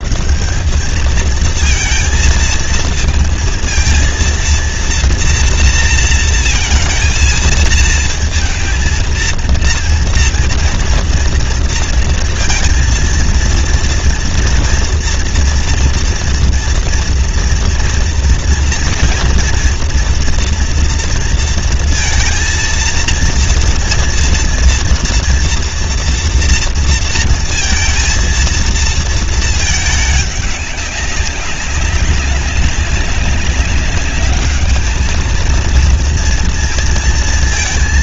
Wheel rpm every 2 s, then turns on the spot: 220, 230, 230, 230, 230, 230, 230, 230, 230, 230, 230, 230, 230, 230, 230, 200, 190, 220, 230.
none